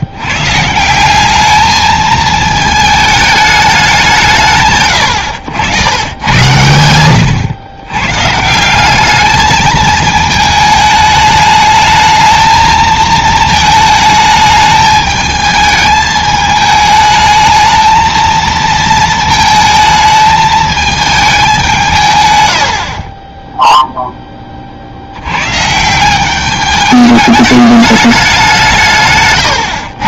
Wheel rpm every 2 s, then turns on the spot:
160, 220, 130, 110, 190, 220, 220, 210, 210, 230, 220, 70, 50, 210, 170.
none